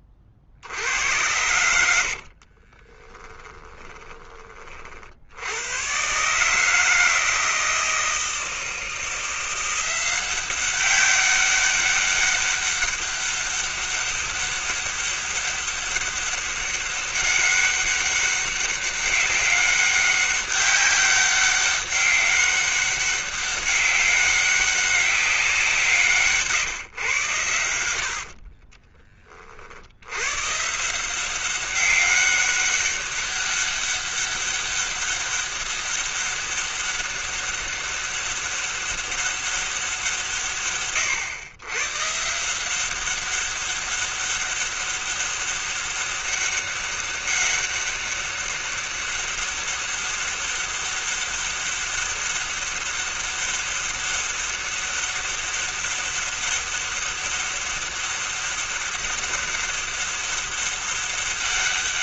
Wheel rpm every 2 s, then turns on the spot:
30, 60, 20, 130, 160, 180, 200, 200, 200, 200, 200, 200, 200, 170, 80, 100, 200, 200, 200, 200, 170, 140, 200, 200, 200, 200, 200, 200, 200, 200, 190.
2-4